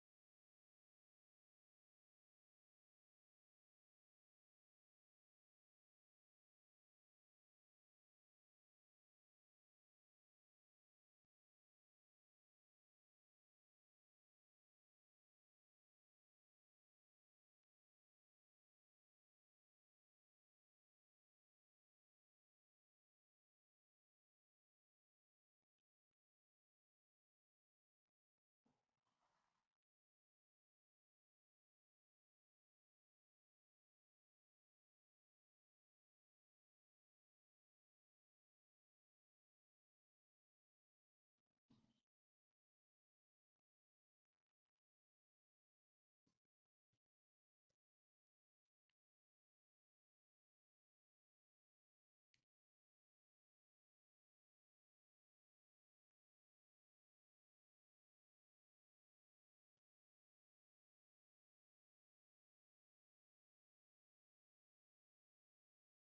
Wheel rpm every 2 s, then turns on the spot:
0, 0, 0, 0, 0, 0, 0, 0, 0, 0, 0, 0, 0, 0, 0, 0, 0, 0, 0, 0, 0, 0, 0, 0, 0, 0, 0, 0, 0, 0, 0, 0, 0.
none